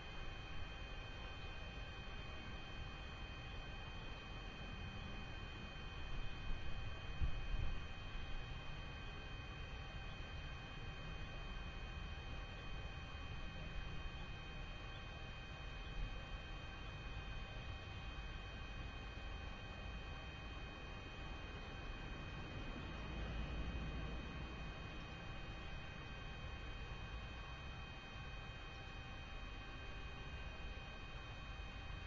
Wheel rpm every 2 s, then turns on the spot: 0, 0, 0, 0, 0, 0, 0, 0, 0, 0, 0, 0, 0, 0, 0, 0.
none